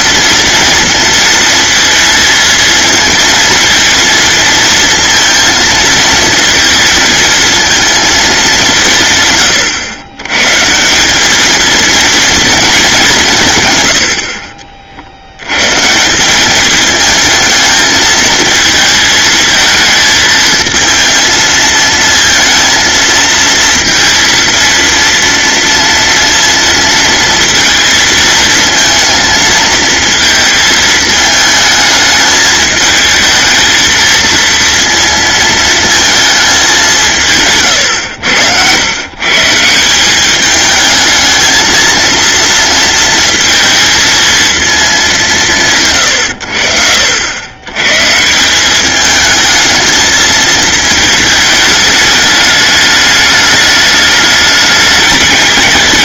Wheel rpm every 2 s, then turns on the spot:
230, 230, 230, 230, 170, 170, 200, 50, 210, 220, 220, 230, 230, 230, 230, 220, 220, 230, 190, 110, 220, 230, 210, 70, 200, 220, 210, 210.
none